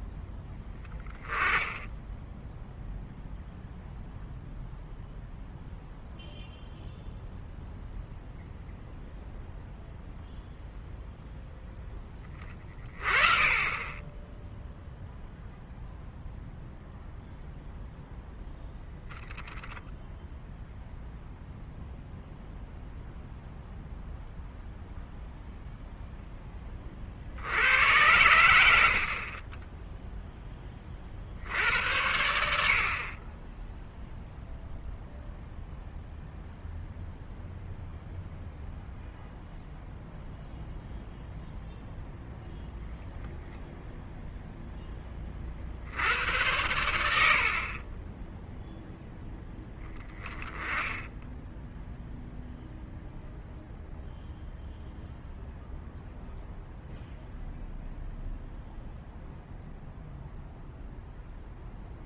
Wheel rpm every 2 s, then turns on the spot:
10, 0, 0, 0, 0, 0, 20, 0, 0, 0, 0, 0, 0, 30, 60, 30, 50, 0, 0, 0, 0, 0, 10, 90, 0, 10, 0, 0, 0, 0, 0.
none